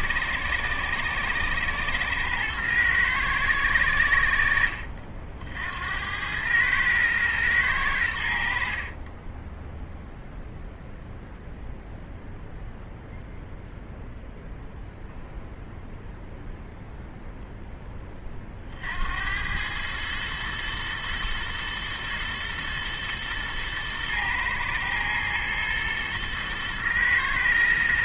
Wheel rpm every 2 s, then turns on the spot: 110, 110, 70, 110, 50, 0, 0, 0, 0, 60, 110, 110, 110, 110.
none